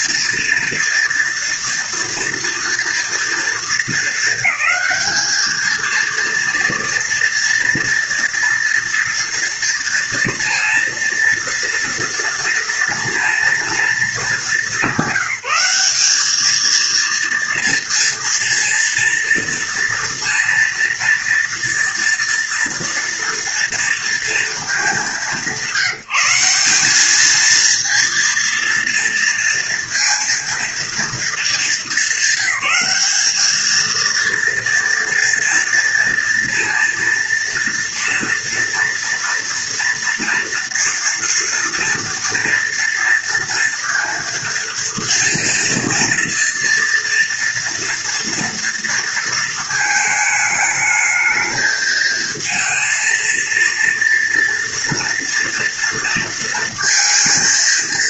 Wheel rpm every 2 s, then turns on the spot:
230, 230, 210, 230, 240, 230, 230, 200, 230, 230, 230, 230, 210, 200, 230, 230, 200, 230, 230, 230, 230, 230, 230, 230, 230, 220, 230, 230, 230.
none